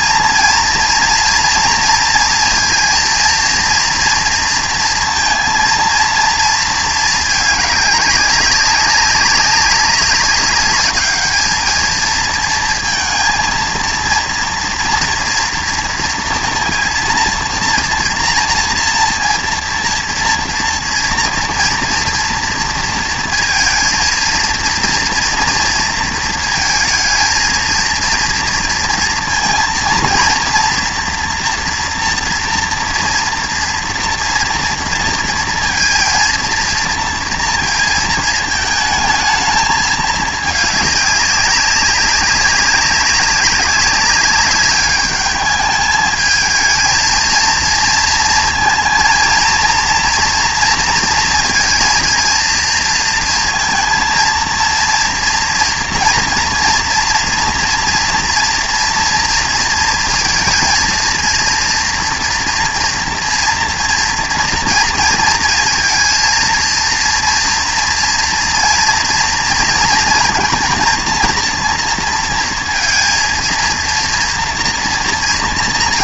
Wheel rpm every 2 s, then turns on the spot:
230, 230, 230, 230, 200, 200, 230, 230, 230, 230, 230, 230, 230, 220, 230, 230, 230, 230, 230, 220, 210, 190, 200, 220, 230, 230, 230, 230, 240, 230, 230, 230, 230, 230, 230, 220, 230, 230.
none